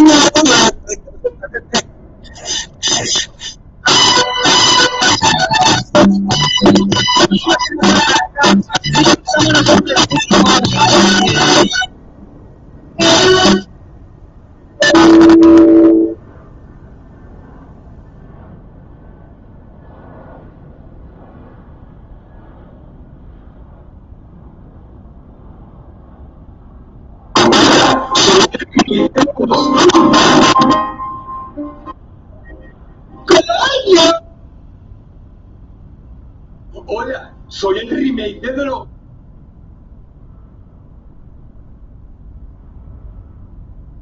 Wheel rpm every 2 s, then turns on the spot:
0, 0, 0, 0, 0, 0, 0, 0, 0, 0, 0, 0, 0, 0, 0, 0, 0, 0, 0, 0, 0, 0.
none